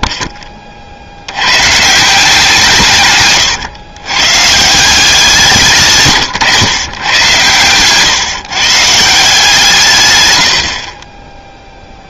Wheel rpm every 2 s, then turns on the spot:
30, 150, 160, 120, 150, 60.
none